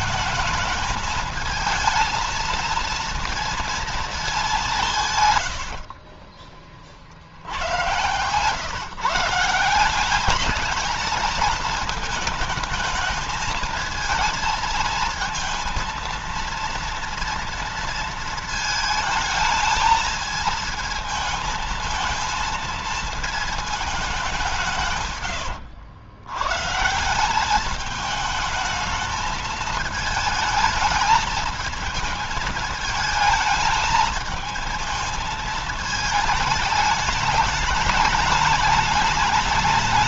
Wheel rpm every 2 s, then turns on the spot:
220, 230, 200, 30, 120, 210, 220, 230, 230, 230, 220, 230, 180, 120, 220, 220, 220, 220, 220, 210.
none